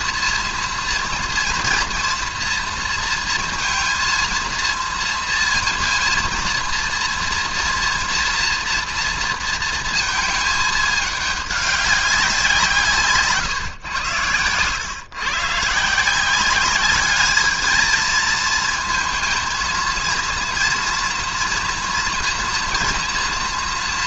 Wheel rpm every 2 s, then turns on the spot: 240, 230, 230, 230, 230, 210, 170, 110, 200, 220, 230, 240.
none